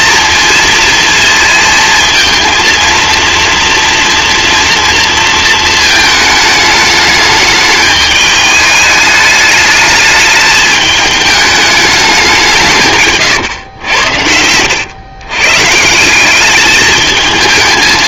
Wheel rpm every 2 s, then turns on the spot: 230, 230, 230, 210, 210, 210, 150, 100, 210.
none